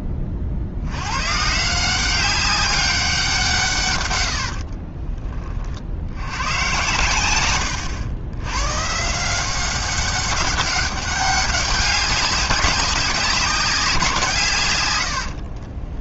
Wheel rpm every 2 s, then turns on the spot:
40, 190, 80, 100, 110, 190, 200, 140.
4-6